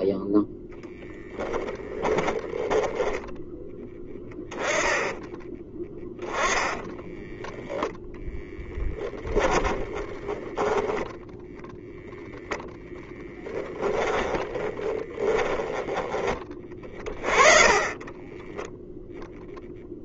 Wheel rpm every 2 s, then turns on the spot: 0, 10, 10, 20, 20, 20, 0, 20, 20, 10.
4-12 14-16 18-20